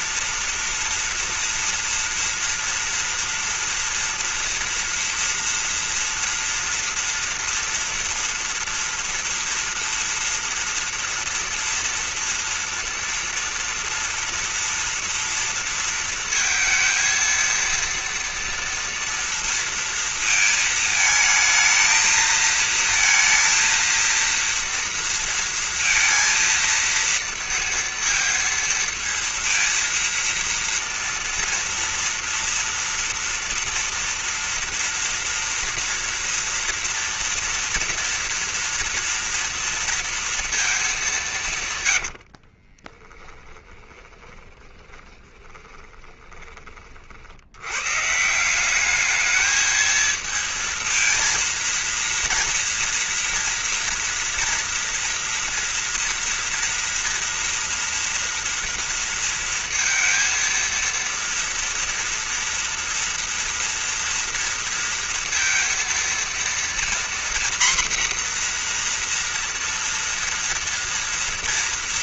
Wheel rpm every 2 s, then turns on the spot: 240, 230, 230, 230, 240, 240, 230, 230, 230, 230, 220, 230, 230, 230, 230, 230, 230, 230, 230, 230, 230, 60, 10, 20, 180, 230, 230, 230, 240, 230, 230, 230, 230, 230, 250, 230.
42-46